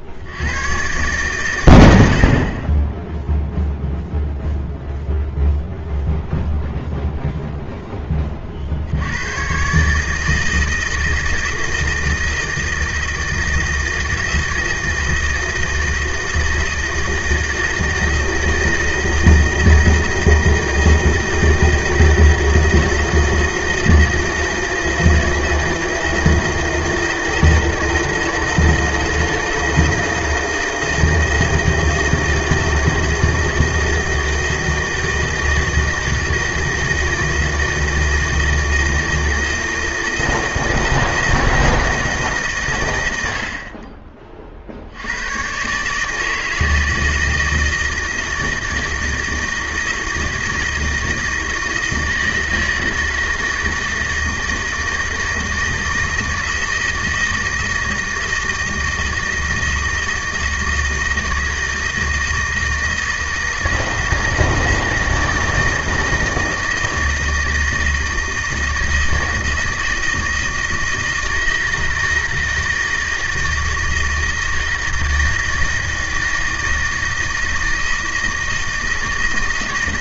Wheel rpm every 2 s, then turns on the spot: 60, 30, 0, 0, 100, 160, 160, 160, 160, 160, 160, 160, 160, 160, 160, 160, 160, 160, 160, 160, 170, 90, 90, 160, 160, 160, 160, 160, 160, 160, 160, 160, 160, 160, 160, 160, 160, 160, 160, 160.
none